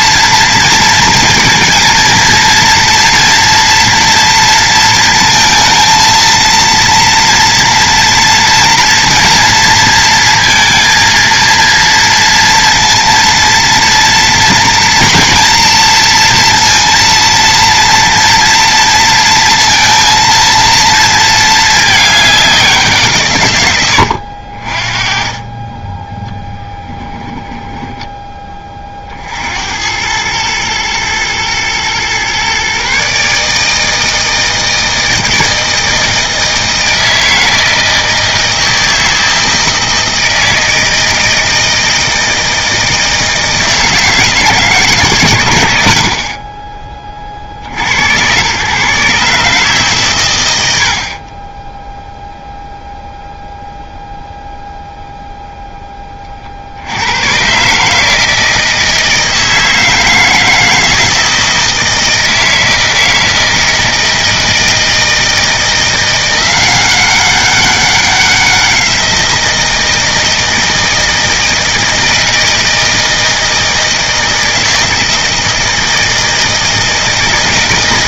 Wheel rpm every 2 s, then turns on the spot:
230, 230, 230, 230, 230, 230, 230, 230, 230, 230, 230, 180, 40, 10, 30, 110, 140, 160, 160, 160, 160, 160, 150, 40, 130, 60, 0, 0, 70, 160, 160, 160, 160, 180, 180, 160, 160, 160, 160.
none